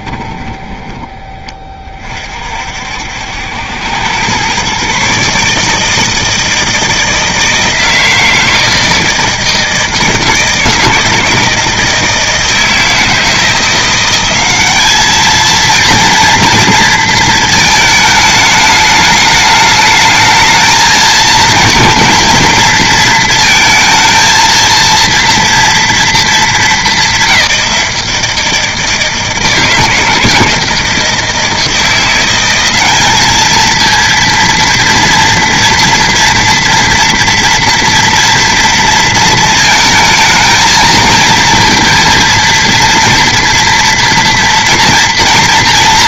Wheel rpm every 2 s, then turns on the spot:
30, 60, 140, 160, 160, 160, 160, 210, 230, 210, 220, 230, 230, 180, 160, 160, 200, 230, 230, 230, 220, 230, 230.
none